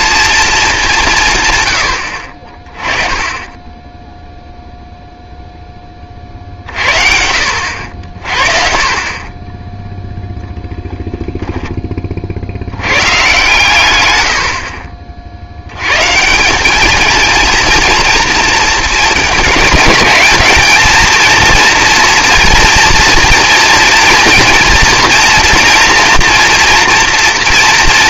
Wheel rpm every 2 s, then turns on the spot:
210, 30, 0, 50, 40, 0, 90, 60, 200, 230, 220, 240, 230, 240.
none